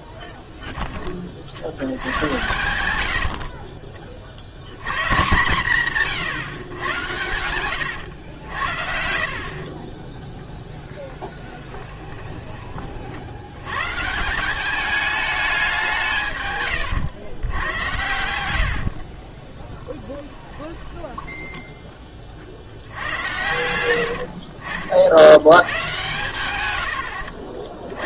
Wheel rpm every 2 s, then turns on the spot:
10, 110, 90, 120, 70, 0, 30, 200, 110, 70, 10, 60, 50, 100.
8-10 18-22